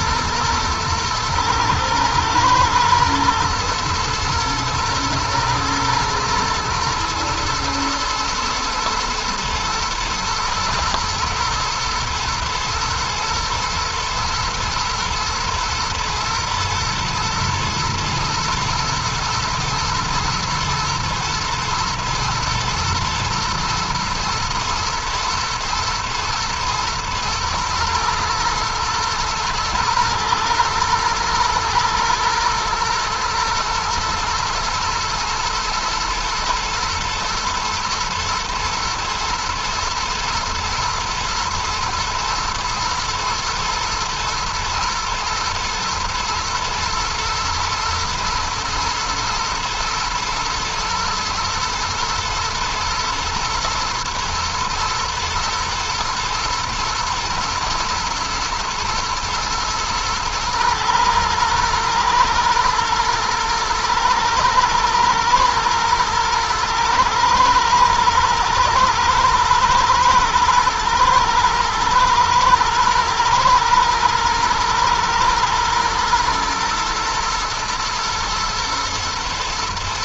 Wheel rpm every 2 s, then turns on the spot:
110, 120, 110, 120, 110, 120, 120, 120, 120, 120, 110, 110, 110, 110, 120, 110, 120, 110, 120, 120, 110, 110, 110, 110, 110, 110, 120, 110, 120, 110, 110, 110, 110, 120, 110, 110, 120, 110, 120, 120.
none